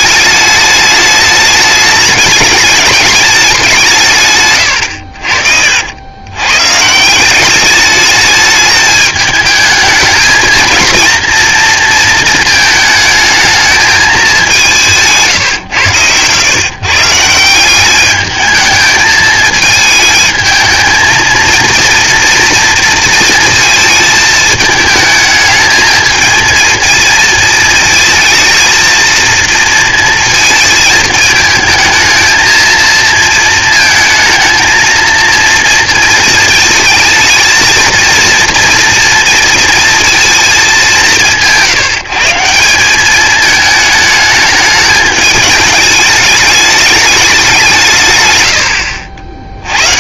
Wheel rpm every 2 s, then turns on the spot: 210, 210, 110, 130, 210, 220, 220, 180, 130, 220, 220, 230, 210, 220, 230, 220, 230, 230, 220, 230, 200, 190, 210, 210, 90.
none